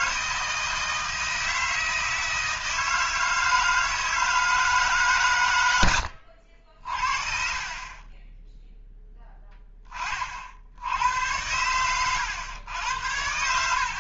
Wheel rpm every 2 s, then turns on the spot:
160, 160, 160, 60, 0, 80, 90.
none